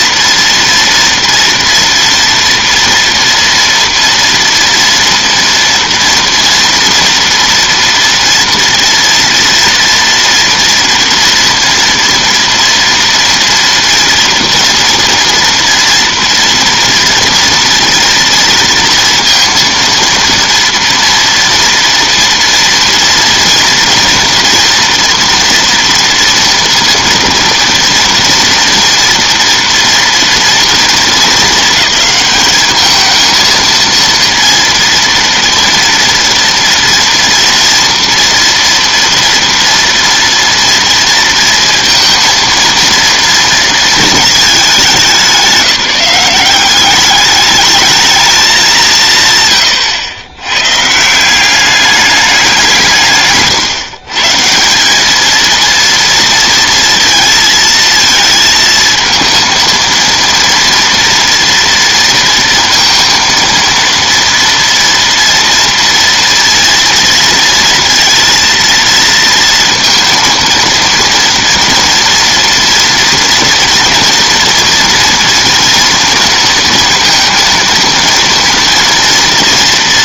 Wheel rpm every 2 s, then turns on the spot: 230, 230, 230, 230, 230, 230, 230, 240, 230, 230, 230, 230, 240, 230, 230, 220, 220, 230, 240, 230, 230, 230, 200, 200, 180, 140, 170, 190, 230, 220, 230, 230, 230, 230, 230, 230, 230, 230, 230, 230.
none